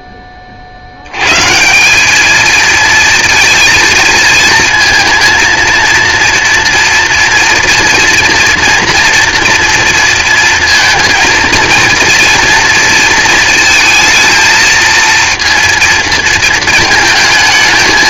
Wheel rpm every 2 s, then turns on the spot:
70, 230, 230, 230, 230, 230, 230, 220, 230.
none